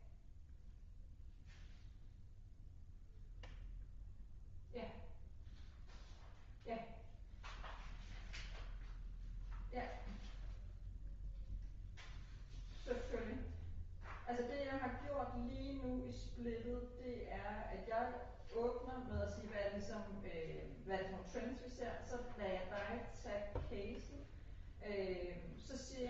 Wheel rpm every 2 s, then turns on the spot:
0, 0, 0, 0, 0, 0, 0, 0, 0, 0, 0, 0, 0.
none